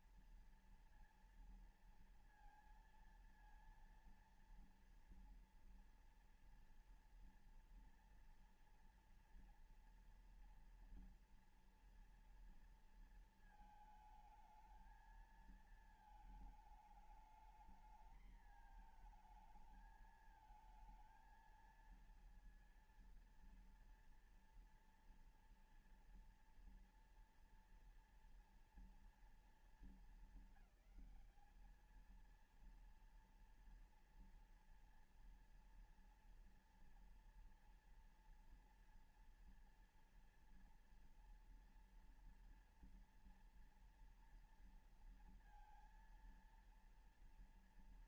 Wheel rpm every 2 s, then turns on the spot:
230, 230, 230, 230, 230, 230, 230, 220, 220, 220, 220, 230, 230, 230, 230, 220, 230, 230, 230, 240, 240, 230, 230, 230.
none